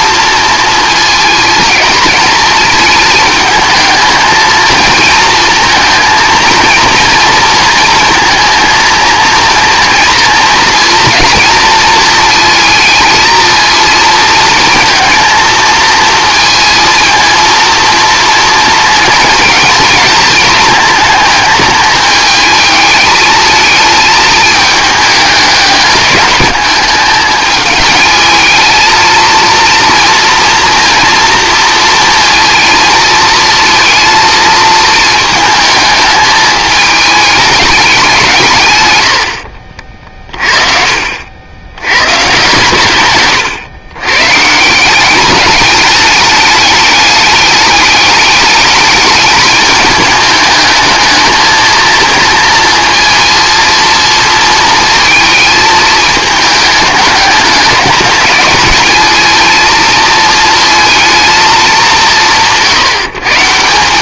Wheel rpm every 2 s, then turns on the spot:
230, 220, 230, 230, 230, 230, 230, 230, 230, 230, 220, 220, 210, 200, 220, 230, 230, 220, 210, 150, 40, 140, 160, 210, 220, 210, 230, 230, 210, 210, 220, 160.
none